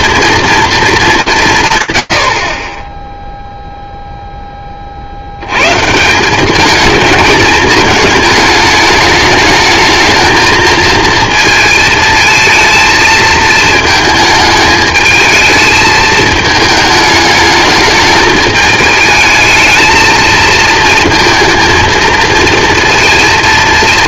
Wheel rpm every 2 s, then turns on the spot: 230, 30, 20, 200, 210, 220, 230, 220, 220, 220, 230, 230.
none